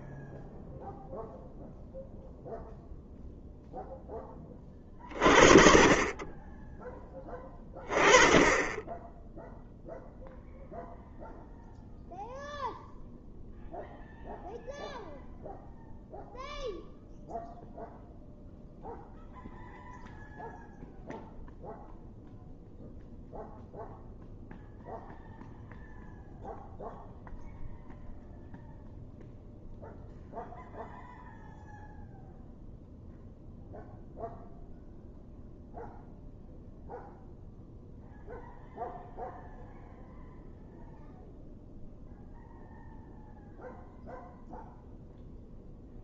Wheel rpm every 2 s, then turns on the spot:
0, 0, 30, 10, 20, 0, 0, 0, 0, 0, 0, 0, 0, 0, 0, 0, 0, 0, 0, 0, 0, 0, 0.
none